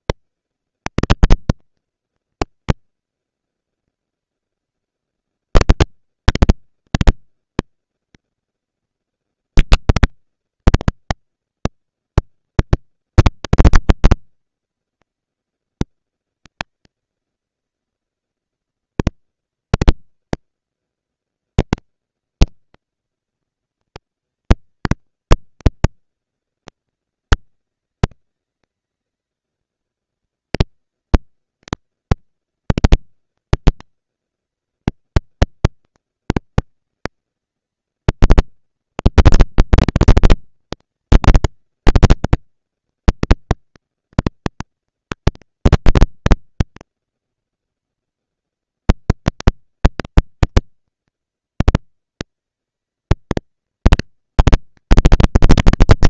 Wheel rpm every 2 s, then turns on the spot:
230, 230, 230, 230, 230, 230, 230, 230, 230, 230, 230, 230, 210, 190, 190, 210, 230, 230, 230, 230, 230, 230, 230, 230, 230, 230, 230, 230.
none